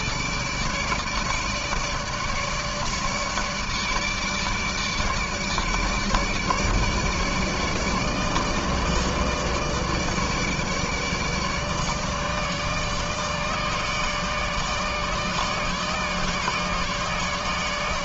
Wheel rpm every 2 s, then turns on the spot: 150, 150, 150, 150, 150, 150, 150, 150, 150.
none